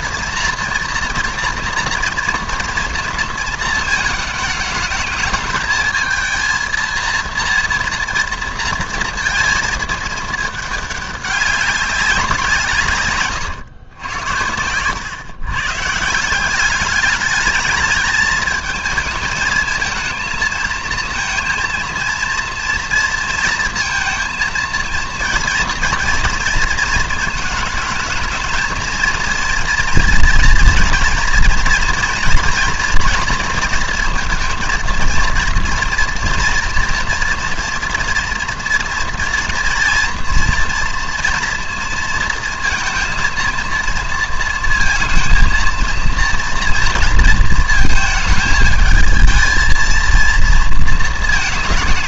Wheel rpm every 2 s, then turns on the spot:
230, 230, 220, 230, 230, 210, 160, 100, 200, 220, 230, 230, 230, 220, 220, 230, 240, 230, 230, 230, 230, 230, 220, 230, 220, 220.
none